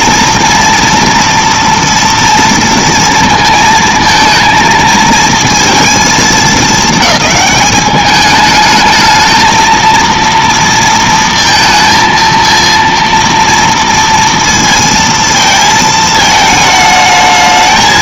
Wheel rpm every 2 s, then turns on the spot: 230, 230, 220, 210, 220, 230, 230, 220, 220.
none